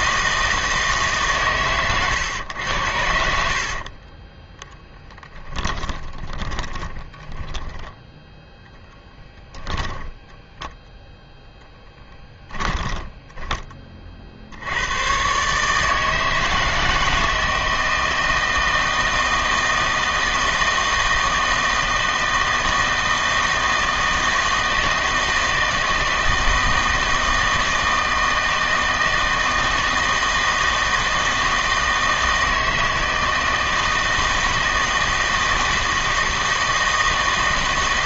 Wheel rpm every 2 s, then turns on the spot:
160, 90, 10, 20, 10, 10, 10, 80, 160, 160, 160, 160, 160, 160, 160, 160, 160, 160, 160.
4-8 12-14